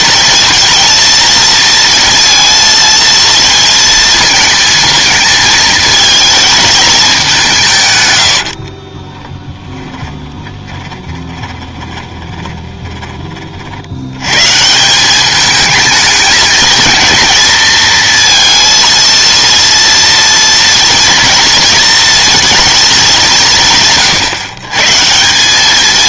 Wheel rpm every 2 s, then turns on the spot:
230, 230, 220, 220, 40, 20, 20, 140, 220, 230, 240, 230, 140.
8-14